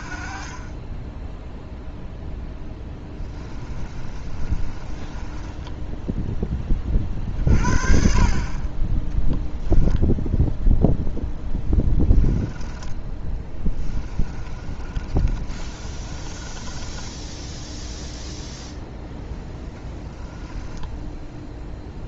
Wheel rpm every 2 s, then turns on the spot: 30, 10, 30, 20, 30, 0, 10, 30, 20, 0, 10.
0-6 12-18